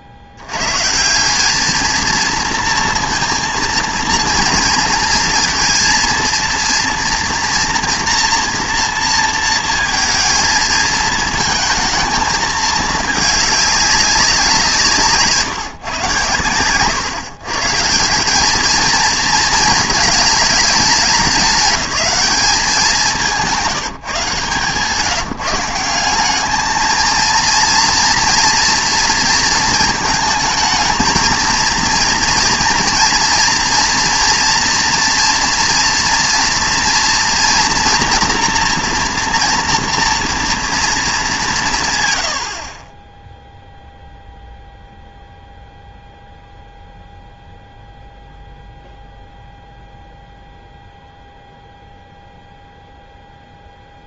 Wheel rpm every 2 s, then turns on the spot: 120, 230, 230, 230, 230, 220, 220, 160, 110, 220, 210, 190, 150, 220, 230, 220, 230, 230, 230, 230, 230, 50, 0, 0, 0, 0, 0.
none